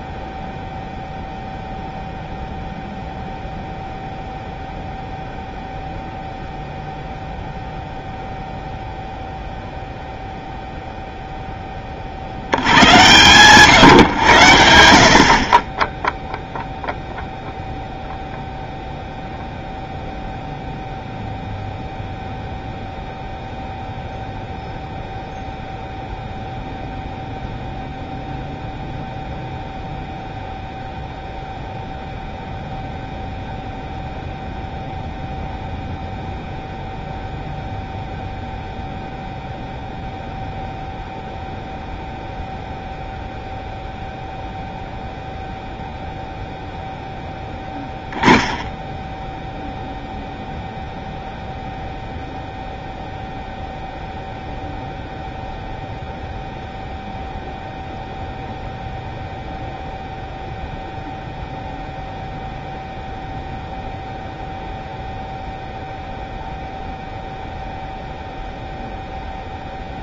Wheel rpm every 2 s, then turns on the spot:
0, 0, 0, 0, 0, 0, 80, 90, 0, 0, 0, 0, 0, 0, 0, 0, 0, 0, 0, 0, 0, 0, 0, 0, 10, 0, 0, 0, 0, 0, 0, 0, 0, 0, 0.
none